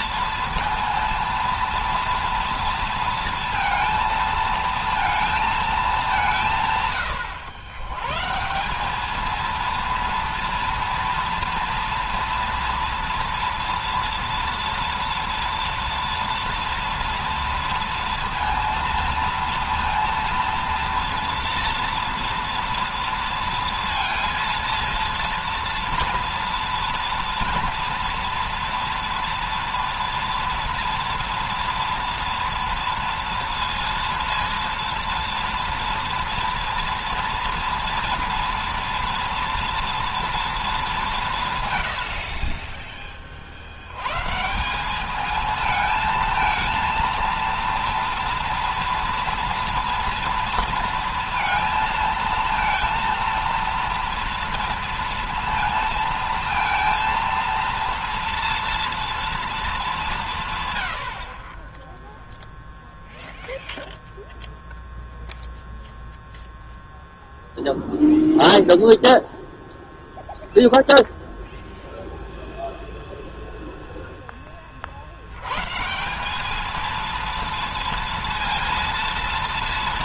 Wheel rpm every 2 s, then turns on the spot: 230, 230, 230, 160, 160, 230, 230, 230, 230, 230, 230, 230, 230, 230, 240, 230, 230, 230, 230, 230, 230, 60, 150, 220, 230, 230, 230, 230, 230, 230, 140, 0, 0, 0, 0, 0, 0, 20, 200, 230.
none